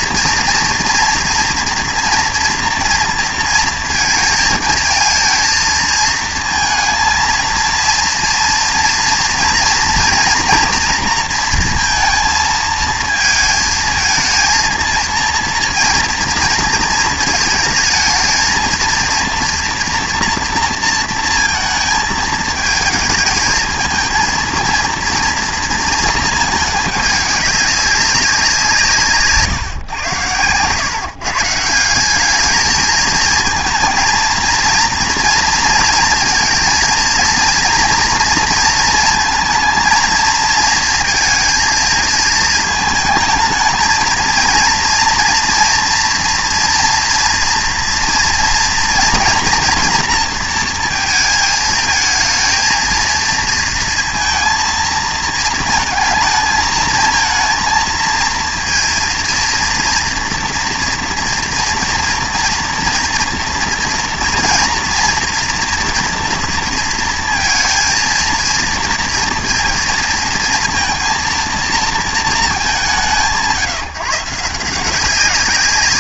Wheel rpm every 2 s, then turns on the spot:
240, 230, 220, 220, 230, 230, 230, 230, 220, 230, 230, 220, 230, 210, 170, 130, 220, 220, 230, 230, 230, 230, 230, 230, 230, 230, 220, 230, 220, 230, 230, 230, 230, 230, 230, 230, 210, 170.
none